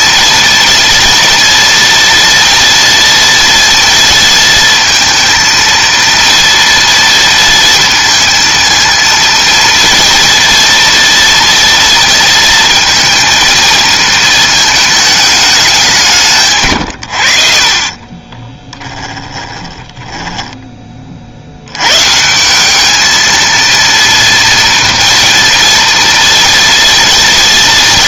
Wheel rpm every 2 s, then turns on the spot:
240, 230, 230, 230, 230, 230, 230, 220, 140, 20, 10, 180, 230, 230.
18-22